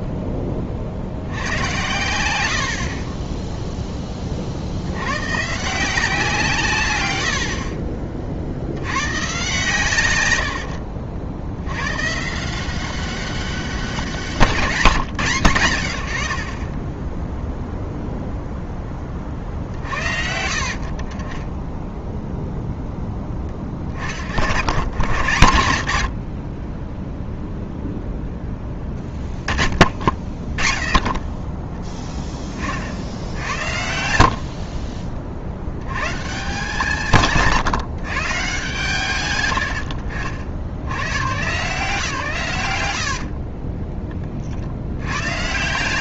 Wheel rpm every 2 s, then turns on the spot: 30, 70, 70, 140, 70, 80, 170, 190, 40, 0, 60, 0, 80, 30, 10, 20, 30, 50, 160, 140, 70, 110, 60.
10-12 34-36